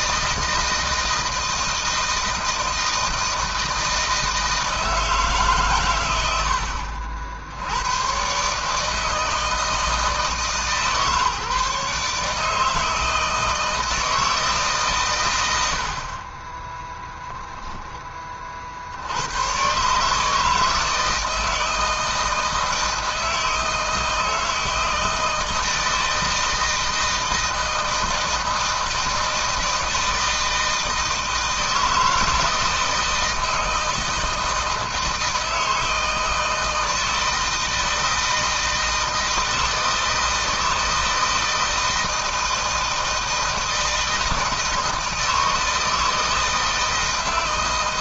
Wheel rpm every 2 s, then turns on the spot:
160, 160, 160, 70, 150, 150, 160, 120, 10, 70, 160, 160, 160, 160, 160, 160, 160, 160, 160, 160, 160, 160, 160, 160.
16-18